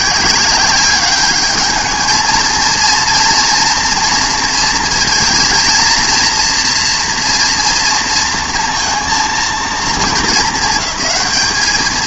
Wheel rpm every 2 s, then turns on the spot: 190, 230, 230, 230, 230, 220.
none